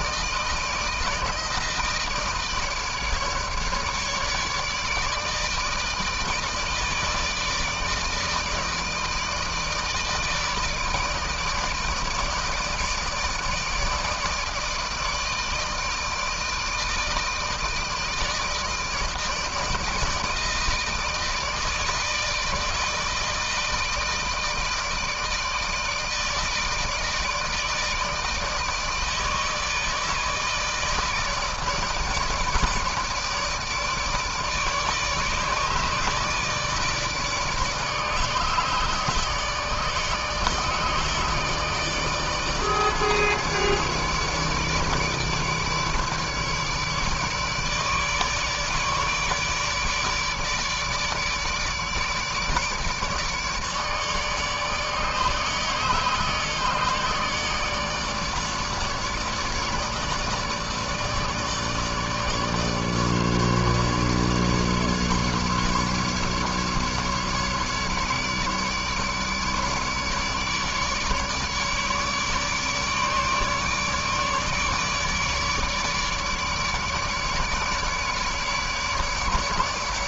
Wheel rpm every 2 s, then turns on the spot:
160, 160, 150, 160, 160, 160, 160, 160, 160, 160, 160, 160, 160, 160, 160, 150, 150, 150, 150, 150, 160, 150, 160, 150, 150, 150, 150, 150, 150, 150, 150, 150, 150, 150, 150, 150, 150, 150, 150, 150.
none